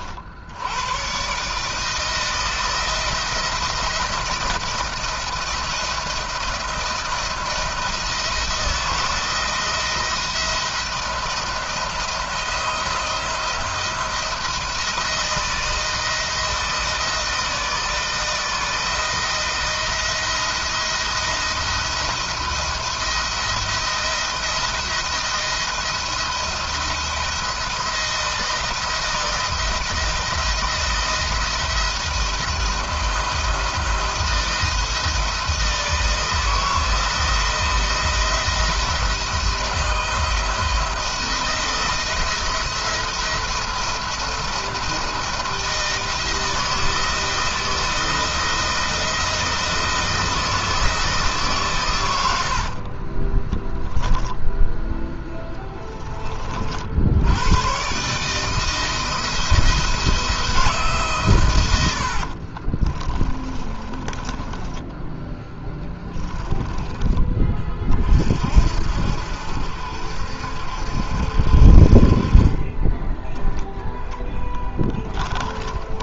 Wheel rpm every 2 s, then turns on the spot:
110, 170, 170, 170, 170, 170, 170, 170, 160, 160, 170, 160, 170, 170, 170, 170, 170, 160, 160, 170, 170, 170, 170, 160, 170, 160, 50, 10, 60, 160, 150, 30, 10, 20, 60, 70, 20, 20.
52-54 62-66 74-76